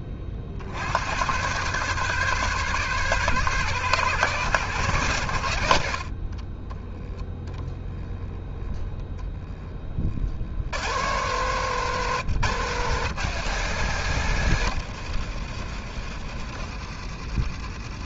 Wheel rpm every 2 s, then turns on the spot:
50, 130, 130, 30, 0, 70, 160, 120, 60.
14-16